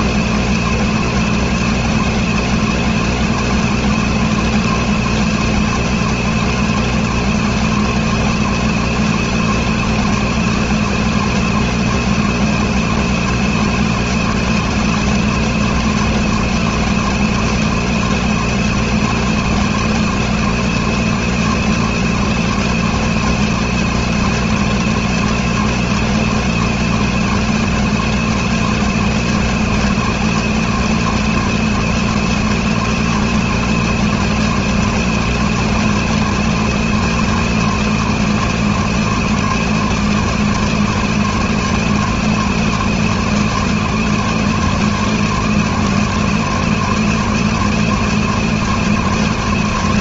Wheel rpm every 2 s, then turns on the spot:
240, 240, 240, 240, 240, 240, 240, 240, 240, 240, 240, 240, 250, 240, 240, 240, 240, 240, 240, 240, 240, 230, 240, 230, 240.
none